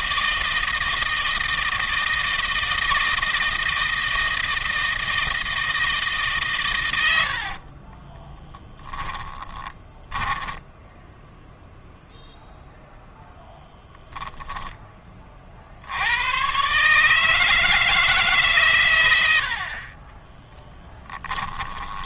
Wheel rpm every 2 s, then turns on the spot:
160, 160, 160, 100, 20, 10, 0, 30, 140, 110, 10.
6-10 20-22